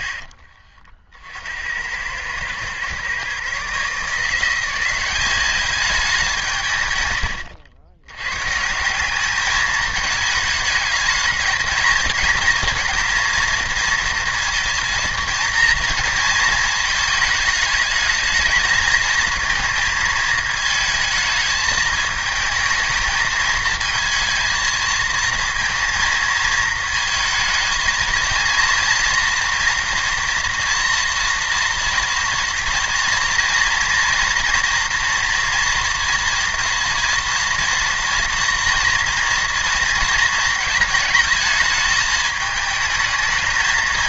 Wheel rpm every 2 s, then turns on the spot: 50, 110, 180, 150, 150, 220, 220, 230, 220, 220, 220, 220, 230, 220, 230, 240, 230, 230, 230, 240, 220, 220.
none